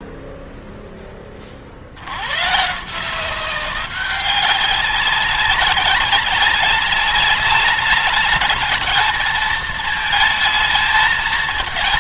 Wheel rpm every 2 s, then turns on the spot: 0, 130, 190, 200, 220, 220.
none